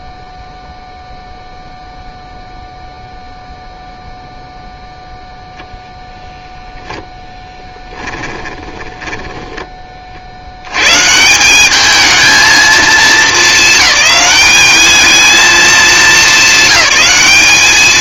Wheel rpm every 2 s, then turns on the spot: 0, 0, 0, 0, 20, 100, 220, 210, 190.
8-10